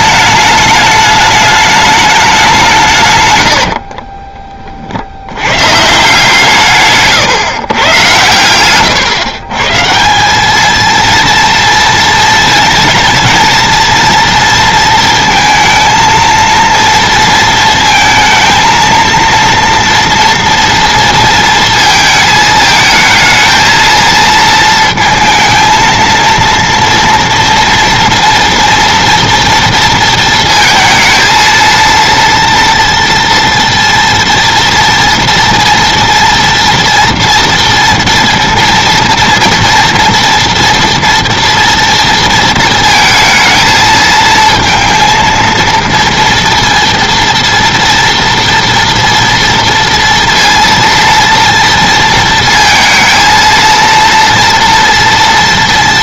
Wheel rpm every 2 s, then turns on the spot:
210, 180, 30, 150, 120, 210, 230, 230, 230, 230, 230, 220, 230, 230, 240, 230, 230, 230, 230, 230, 230, 230, 230, 230, 240, 230, 230, 230.
none